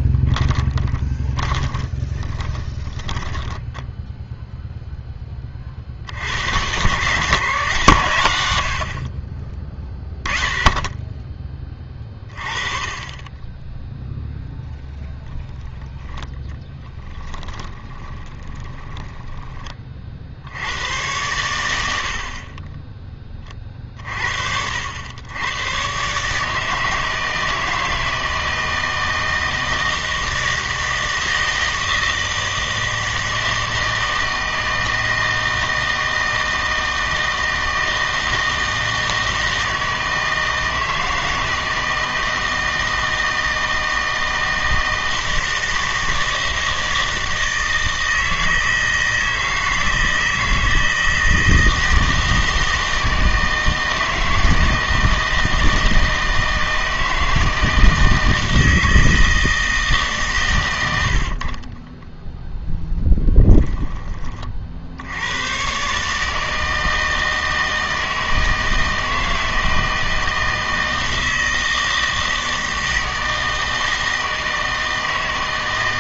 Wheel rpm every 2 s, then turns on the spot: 20, 20, 0, 110, 30, 10, 20, 0, 10, 20, 80, 20, 70, 150, 160, 160, 160, 160, 160, 160, 160, 160, 160, 160, 160, 160, 160, 160, 160, 160, 110, 0, 40, 160, 160, 160, 160, 160.
0-4 16-20